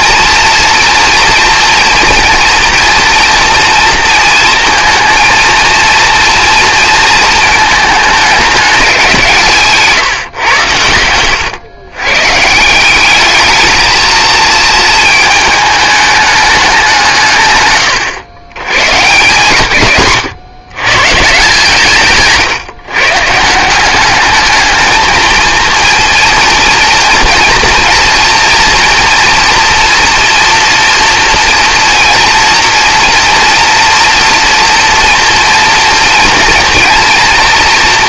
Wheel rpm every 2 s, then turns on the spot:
230, 230, 230, 230, 190, 110, 180, 220, 180, 130, 140, 140, 220, 230, 240, 230, 230, 240, 230.
none